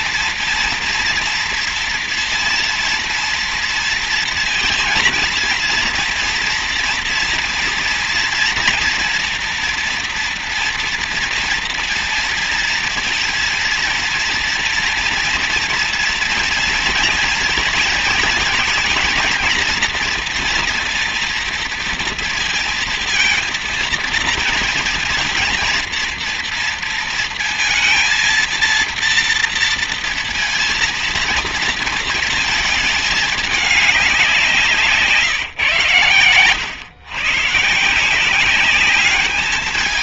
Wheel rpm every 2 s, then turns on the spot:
240, 230, 230, 230, 240, 230, 230, 230, 240, 220, 230, 230, 230, 230, 230, 230, 210, 180, 120, 210.
none